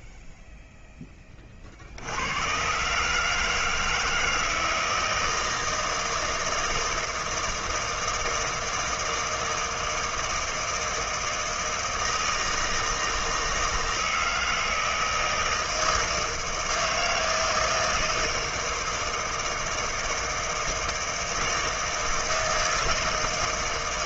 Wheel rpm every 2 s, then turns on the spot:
0, 110, 160, 160, 160, 160, 160, 160, 160, 160, 160, 160.
none